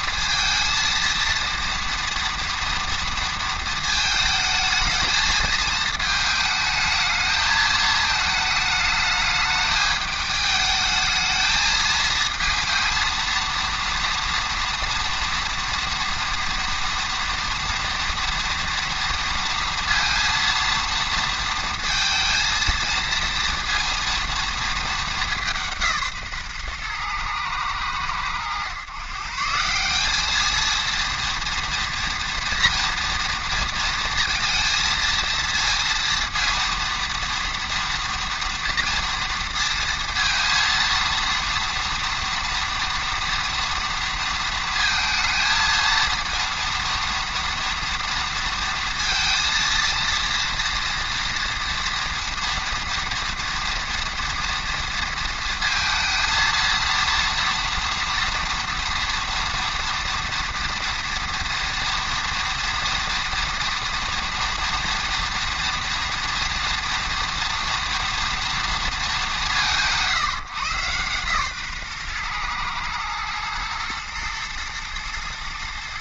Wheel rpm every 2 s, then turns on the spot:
230, 230, 220, 220, 220, 210, 230, 230, 230, 230, 230, 230, 230, 130, 120, 220, 230, 230, 230, 230, 230, 230, 230, 230, 230, 230, 230, 230, 230, 230, 230, 230, 230, 230, 230, 140, 120, 120.
none